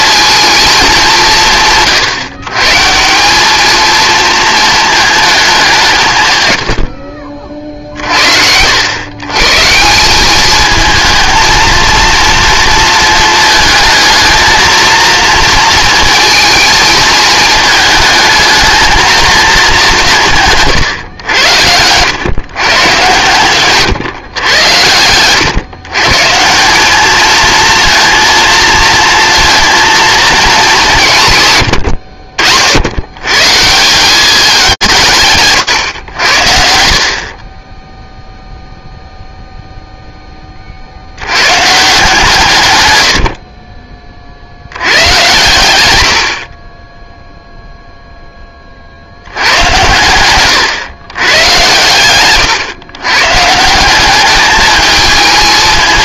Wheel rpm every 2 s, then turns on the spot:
210, 130, 220, 70, 90, 220, 220, 230, 220, 220, 130, 120, 110, 190, 230, 190, 80, 180, 60, 0, 60, 110, 90, 20, 60, 110, 120, 220.
24-26